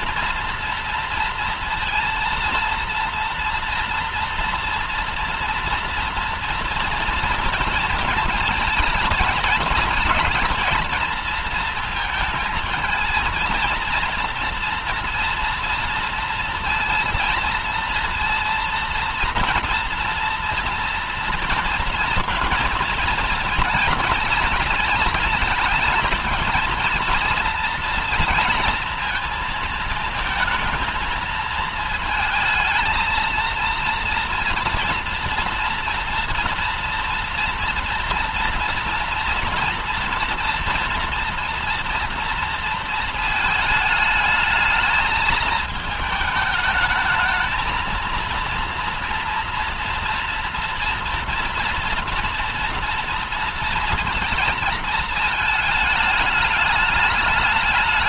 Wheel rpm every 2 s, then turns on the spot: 230, 230, 230, 230, 230, 230, 230, 230, 230, 230, 240, 230, 220, 230, 230, 220, 220, 230, 230, 230, 230, 230, 220, 220, 230, 230, 230, 230, 210.
none